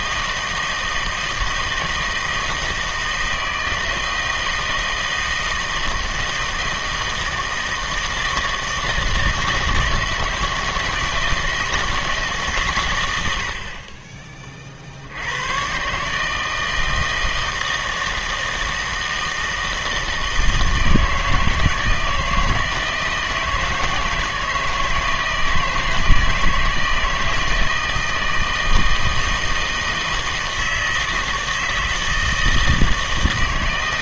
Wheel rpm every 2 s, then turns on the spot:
160, 160, 160, 160, 160, 170, 130, 50, 160, 160, 160, 160, 160, 160, 160, 160, 160.
none